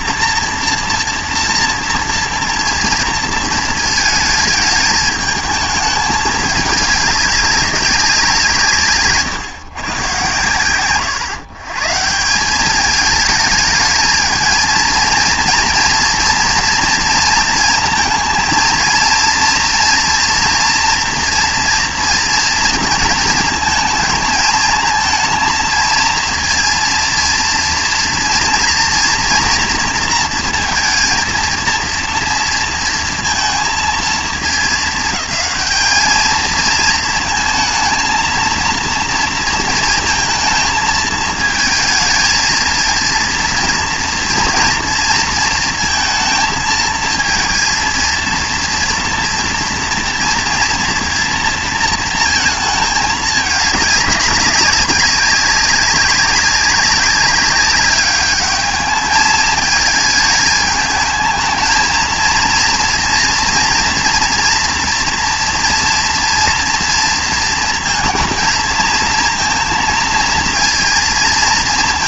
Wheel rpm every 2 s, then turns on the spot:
230, 240, 220, 210, 170, 120, 200, 220, 230, 230, 230, 230, 220, 230, 240, 230, 230, 220, 220, 230, 220, 220, 230, 230, 230, 230, 220, 200, 200, 210, 220, 230, 230, 230, 230, 230.
none